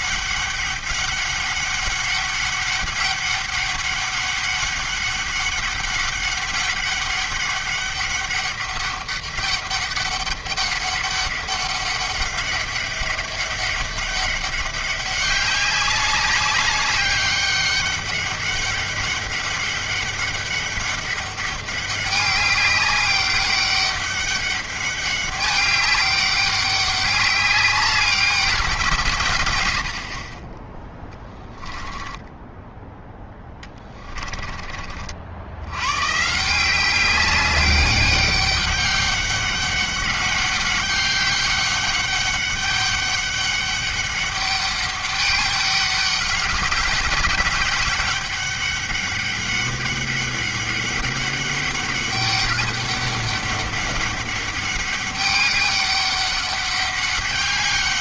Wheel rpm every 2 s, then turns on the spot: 200, 200, 200, 200, 200, 200, 200, 200, 200, 200, 200, 200, 200, 200, 180, 20, 10, 30, 180, 200, 200, 200, 200, 200, 200, 200, 200, 200, 200.
32-34